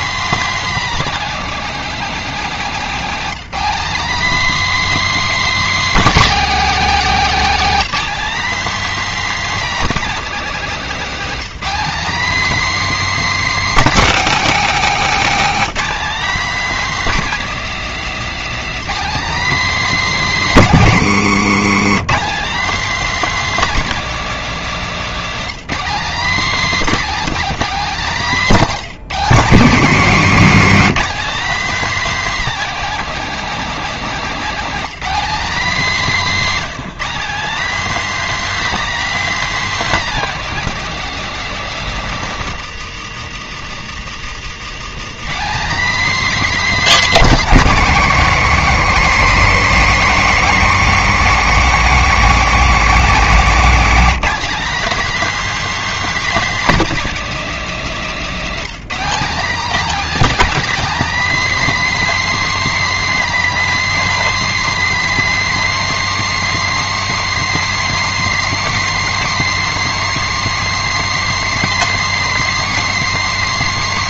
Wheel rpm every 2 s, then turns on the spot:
280, 230, 300, 270, 290, 240, 290, 250, 280, 270, 220, 260, 230, 260, 200, 240, 270, 240, 230, 300, 260, 190, 190, 290, 230, 230, 230, 270, 270, 230, 290, 300, 300, 310, 310, 310, 310.
none